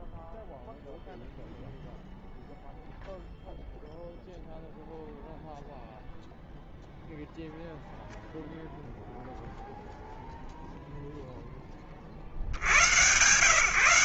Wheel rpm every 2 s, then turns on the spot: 0, 0, 0, 0, 0, 20, 120.
none